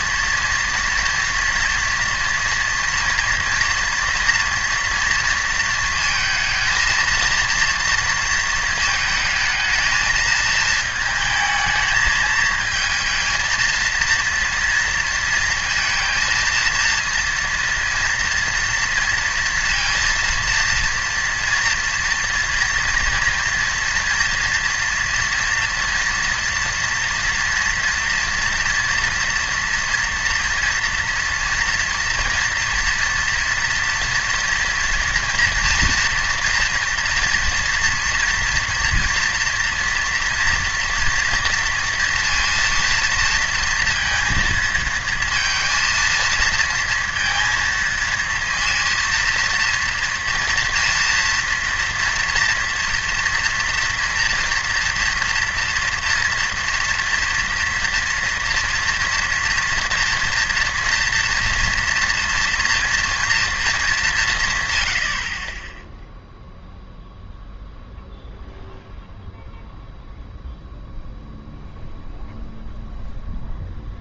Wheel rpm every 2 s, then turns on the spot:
240, 230, 230, 230, 220, 220, 220, 230, 230, 230, 230, 240, 230, 230, 240, 230, 230, 230, 240, 230, 230, 230, 220, 230, 230, 230, 230, 240, 240, 230, 230, 230, 120, 0, 0, 0, 0.
none